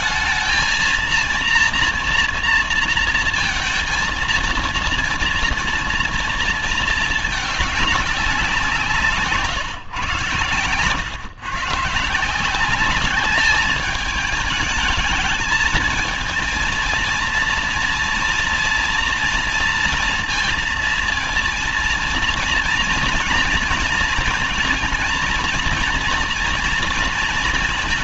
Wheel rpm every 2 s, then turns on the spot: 220, 230, 230, 230, 180, 120, 180, 210, 220, 230, 230, 240, 230, 230.
none